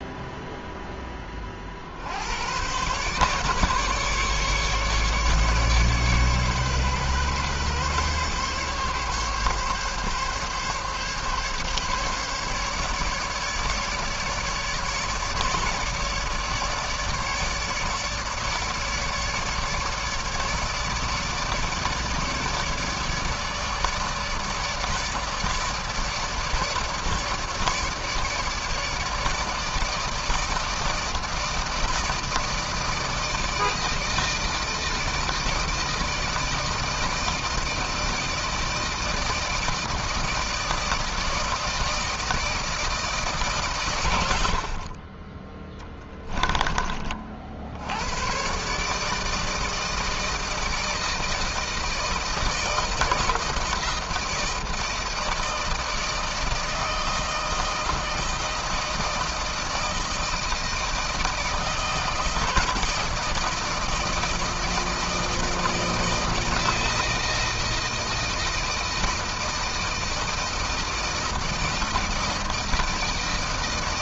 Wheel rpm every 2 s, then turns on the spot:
0, 100, 150, 140, 140, 140, 140, 150, 150, 150, 150, 150, 150, 150, 150, 160, 160, 160, 160, 160, 160, 160, 80, 20, 130, 160, 160, 160, 160, 160, 160, 160, 160, 160, 160, 160, 160.
44-46